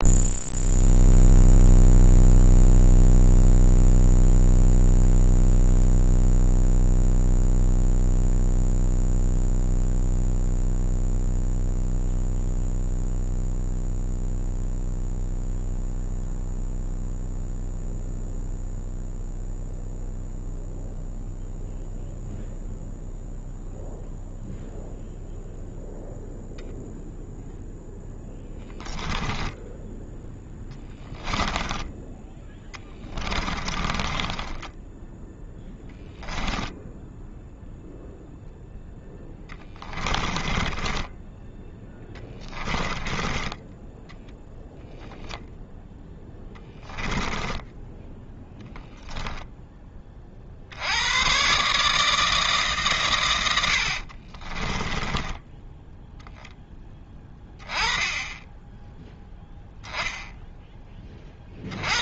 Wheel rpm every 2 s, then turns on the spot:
0, 0, 0, 0, 0, 0, 0, 0, 0, 0, 0, 0, 0, 0, 10, 10, 20, 10, 10, 0, 20, 20, 0, 10, 10, 80, 150, 20, 10, 10, 0.
28-36 40-44 46-50 54-56